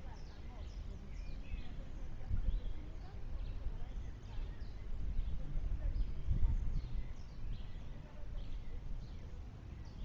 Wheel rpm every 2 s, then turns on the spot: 0, 0, 0, 0, 0.
none